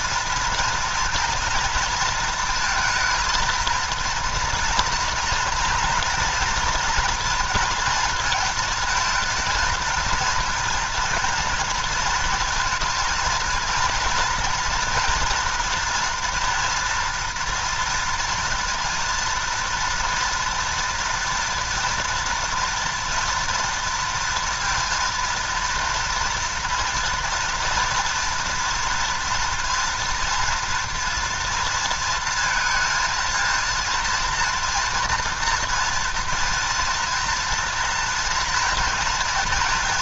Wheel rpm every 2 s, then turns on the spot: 230, 230, 230, 230, 220, 230, 220, 230, 240, 230, 230, 230, 230, 230, 230, 230, 230, 240, 230, 230.
none